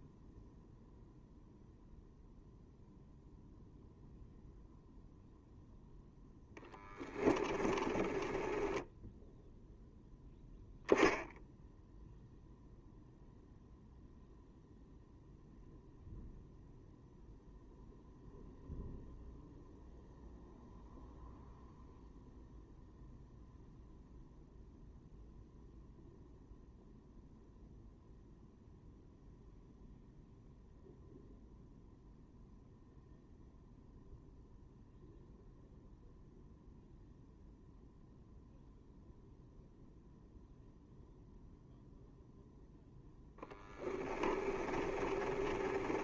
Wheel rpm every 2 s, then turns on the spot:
0, 0, 0, 10, 10, 0, 0, 0, 0, 0, 0, 0, 0, 0, 0, 0, 0, 0, 0, 0, 0, 0, 20.
6-10 44-46